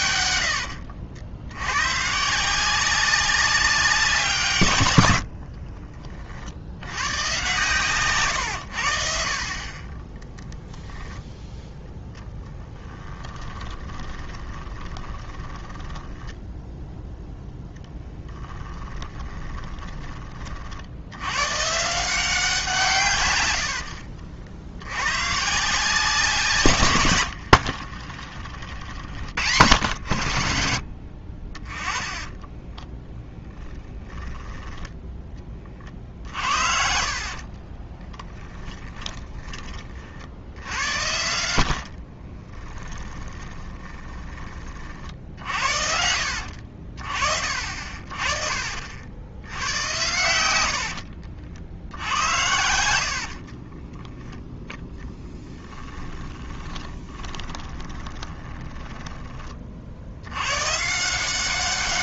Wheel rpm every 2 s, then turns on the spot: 80, 190, 100, 100, 80, 10, 10, 20, 0, 10, 60, 160, 90, 130, 60, 60, 10, 10, 60, 20, 80, 20, 50, 50, 60, 70, 80, 10, 20, 10, 140.
0-2 12-16 18-20 32-40 42-44 50-54 56-60